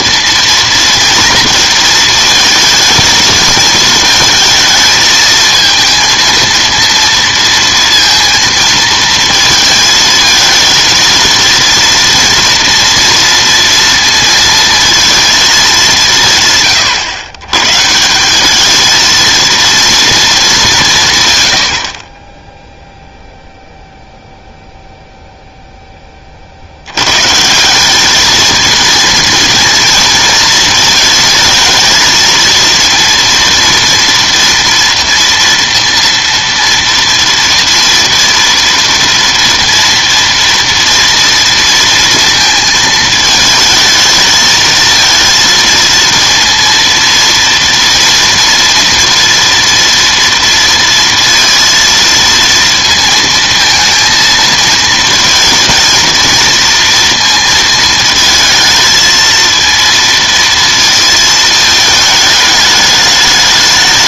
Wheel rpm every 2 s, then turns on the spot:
230, 220, 220, 230, 230, 220, 230, 230, 140, 210, 200, 0, 0, 60, 220, 230, 230, 230, 230, 240, 230, 220, 220, 230, 240, 230, 230, 220, 230, 220, 230, 210.
none